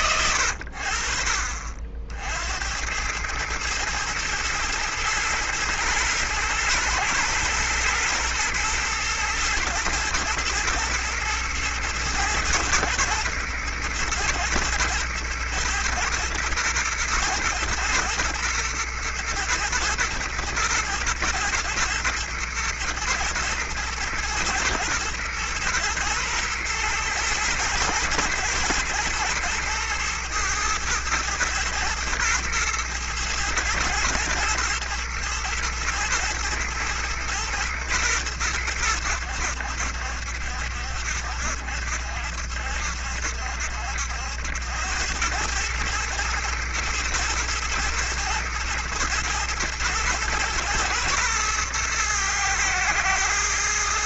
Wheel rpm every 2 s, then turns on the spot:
90, 80, 110, 110, 120, 110, 110, 110, 110, 110, 120, 120, 120, 110, 110, 110, 110, 120, 110, 100, 70, 70, 80, 110, 110, 120, 110.
none